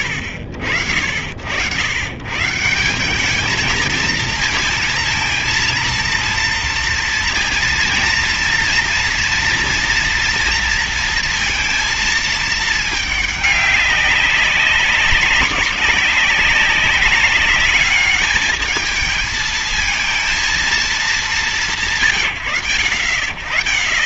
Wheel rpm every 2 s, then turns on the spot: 90, 160, 220, 230, 230, 230, 220, 190, 200, 220, 220, 80.
none